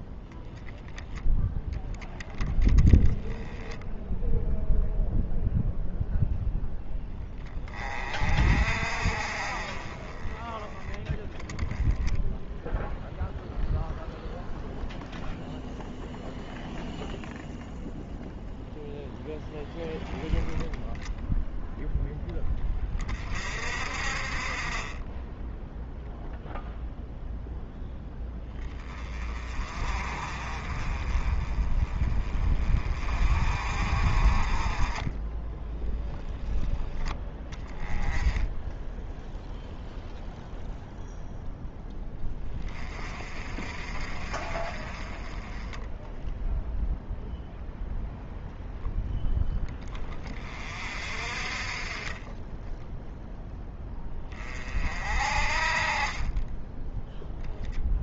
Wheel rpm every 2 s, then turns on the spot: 10, 10, 0, 0, 40, 10, 0, 0, 0, 0, 10, 10, 30, 0, 10, 40, 30, 30, 0, 10, 0, 20, 40, 0, 0, 30, 10, 30, 30.
56-58